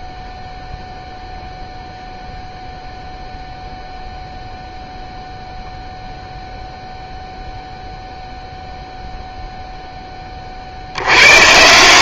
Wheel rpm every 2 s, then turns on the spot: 0, 0, 0, 0, 0, 50.
none